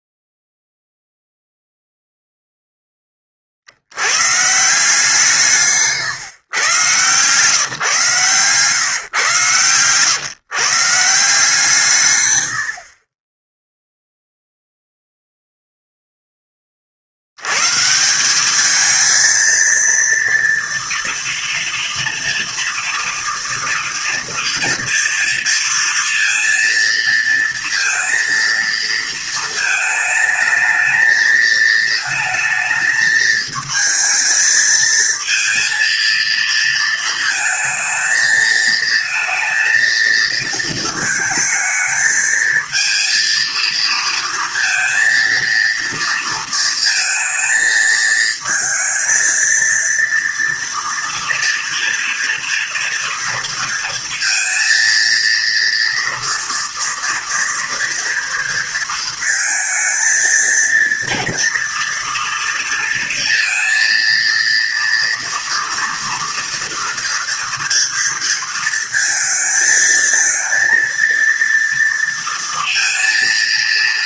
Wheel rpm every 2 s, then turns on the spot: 0, 0, 150, 130, 140, 130, 80, 0, 20, 210, 230, 230, 240, 230, 230, 220, 220, 220, 230, 220, 220, 230, 230, 230, 220, 230, 230, 230, 230, 230, 230, 230, 230, 230, 230, 230, 230.
none